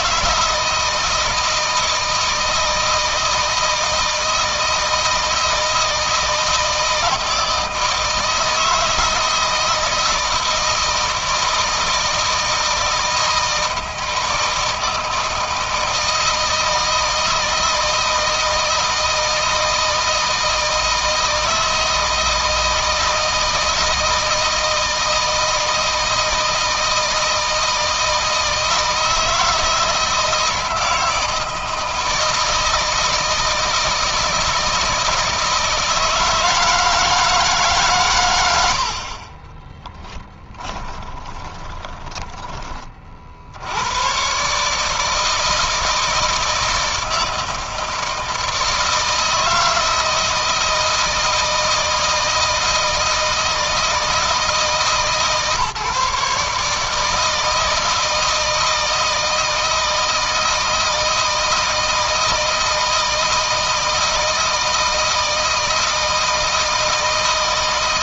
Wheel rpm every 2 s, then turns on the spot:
160, 160, 160, 160, 160, 160, 160, 160, 160, 160, 160, 160, 160, 160, 160, 160, 160, 160, 160, 50, 20, 40, 150, 160, 160, 160, 160, 150, 160, 160, 160, 160, 160, 160.
40-42